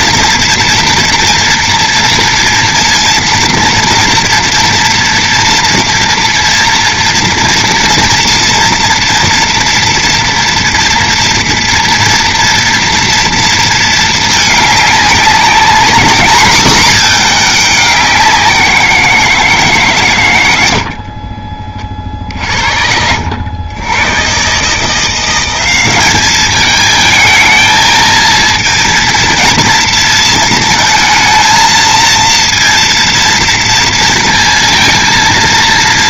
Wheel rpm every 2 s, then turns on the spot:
230, 230, 230, 230, 230, 230, 230, 210, 220, 180, 90, 70, 140, 220, 230, 230, 230, 230.
none